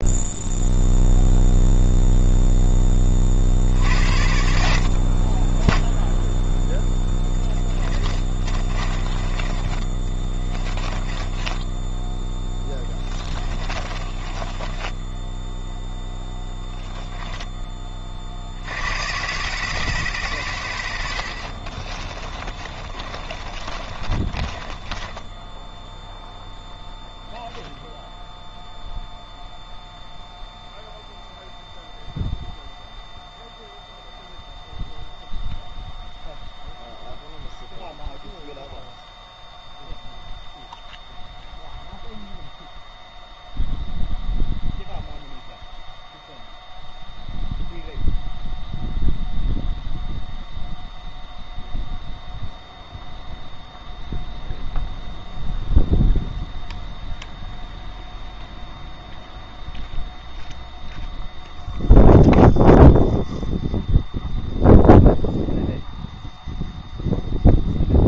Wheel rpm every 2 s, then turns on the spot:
0, 50, 40, 10, 30, 10, 20, 10, 10, 120, 60, 30, 20, 0, 0, 0, 0, 0, 0, 0, 0, 0, 0, 0, 0, 0, 0, 0, 0, 0, 0, 0, 0, 0.
6-18 20-26